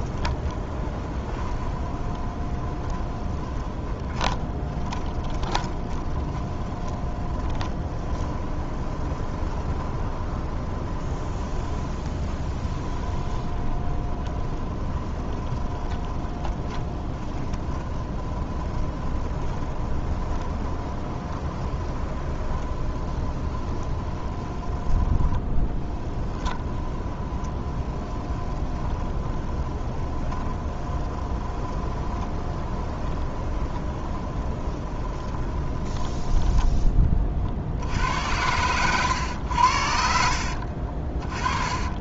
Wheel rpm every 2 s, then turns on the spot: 10, 20, 20, 20, 20, 20, 20, 20, 20, 20, 20, 20, 10, 10, 20, 20, 20, 20, 10, 100, 50.
0-36 38-42